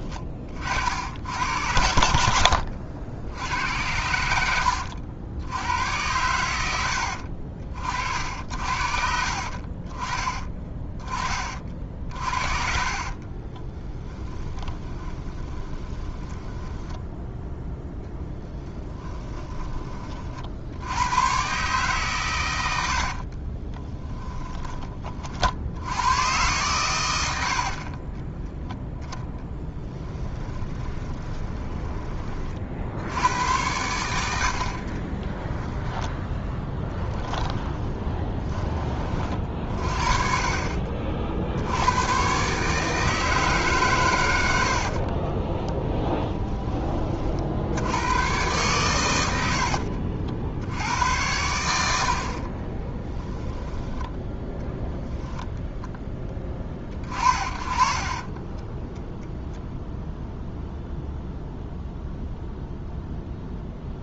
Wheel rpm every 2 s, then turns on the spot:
60, 70, 80, 90, 60, 20, 40, 20, 10, 20, 80, 80, 20, 110, 0, 20, 60, 50, 10, 20, 50, 150, 60, 20, 110, 90, 20, 10, 30, 0, 0, 0.
12-20 22-24 30-32 34-38 52-54